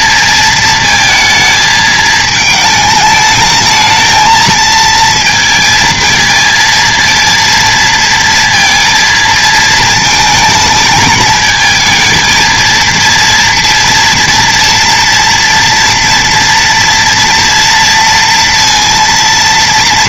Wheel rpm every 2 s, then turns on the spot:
220, 220, 220, 230, 230, 220, 230, 230, 230, 230.
none